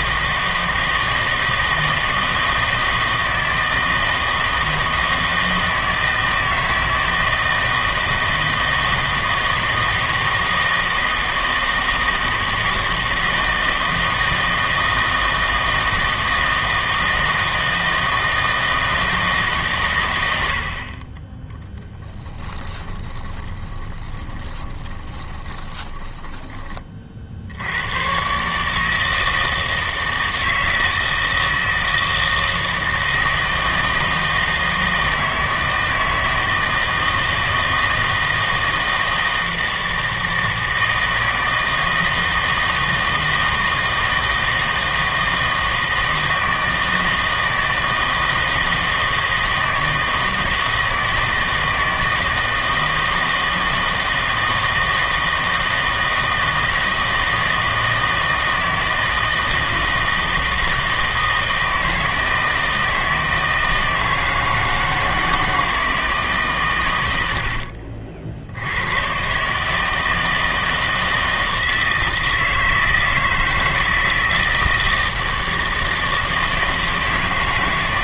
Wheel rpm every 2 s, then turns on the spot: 160, 160, 160, 160, 160, 160, 160, 160, 160, 160, 80, 10, 20, 20, 150, 160, 160, 160, 160, 160, 160, 160, 160, 160, 160, 160, 160, 160, 160, 160, 160, 160, 160, 130, 80, 160, 160, 160, 160.
22-26